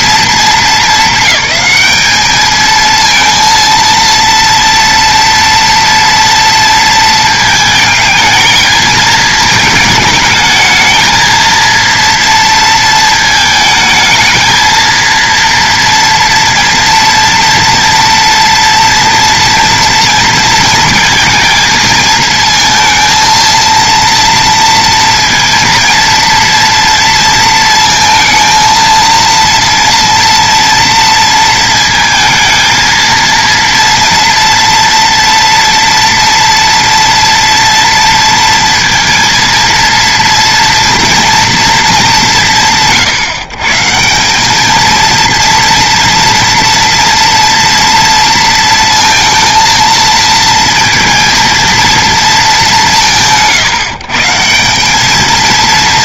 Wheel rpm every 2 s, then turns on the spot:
220, 220, 230, 230, 220, 220, 230, 220, 230, 230, 220, 220, 230, 230, 230, 230, 230, 230, 230, 230, 230, 170, 210, 230, 230, 230, 210, 170.
none